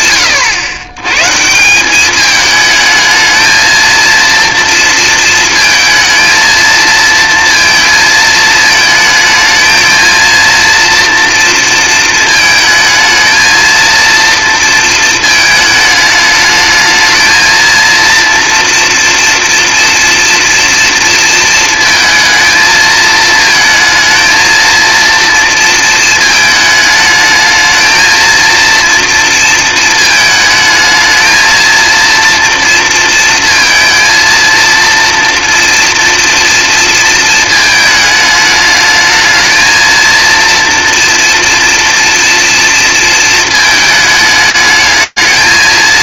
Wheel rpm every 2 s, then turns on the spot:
110, 220, 230, 230, 220, 230, 220, 230, 220, 230, 230, 220, 230, 220, 230, 220, 230, 230, 230, 220, 230, 230, 220.
none